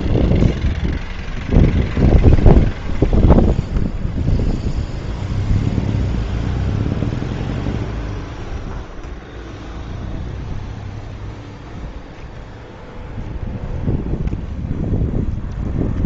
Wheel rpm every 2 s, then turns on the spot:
0, 0, 0, 0, 0, 0, 0, 0.
none